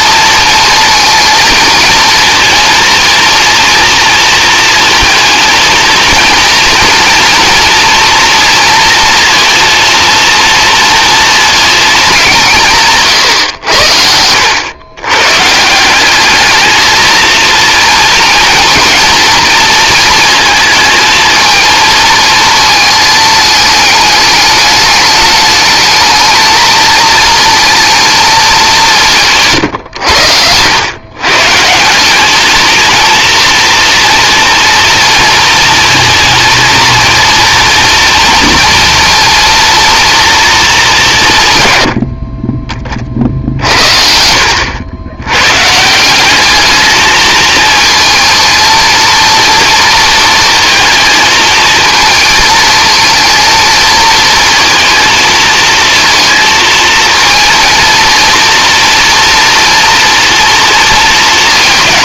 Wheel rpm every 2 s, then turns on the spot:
230, 230, 230, 230, 230, 230, 210, 90, 200, 230, 230, 220, 210, 220, 220, 100, 200, 240, 230, 230, 230, 50, 70, 180, 220, 230, 220, 220, 230, 230, 230.
44-46